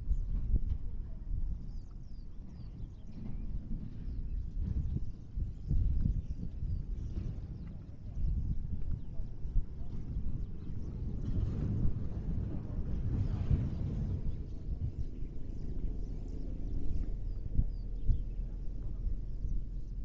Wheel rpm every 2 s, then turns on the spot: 0, 0, 0, 0, 0, 0, 0, 0, 0, 0.
none